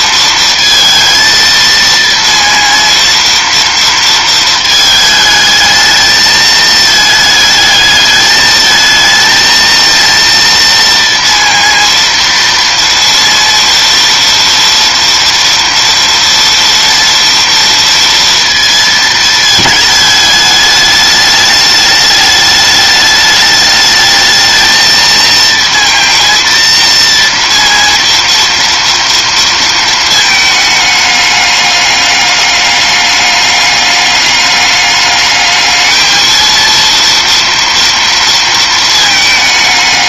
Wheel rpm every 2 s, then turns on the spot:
230, 230, 220, 220, 220, 230, 230, 230, 230, 230, 210, 210, 220, 230, 230, 210, 200, 210, 230, 230.
none